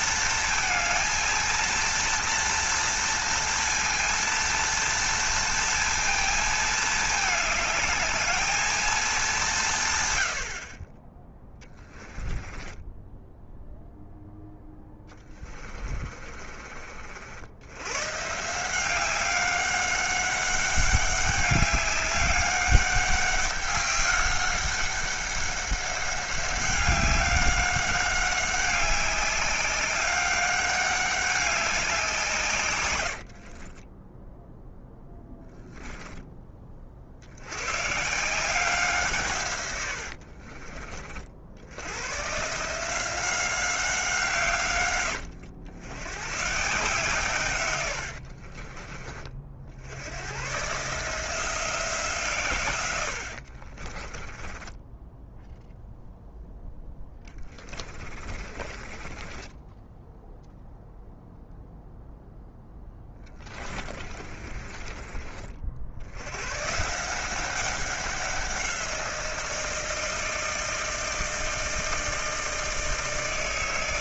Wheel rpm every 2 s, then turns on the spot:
230, 230, 230, 220, 210, 20, 10, 10, 40, 170, 200, 200, 200, 200, 200, 200, 130, 0, 40, 170, 50, 160, 130, 140, 40, 130, 110, 10, 10, 30, 0, 10, 30, 130, 180, 160, 160.
12-16 40-42 48-50 54-60 62-66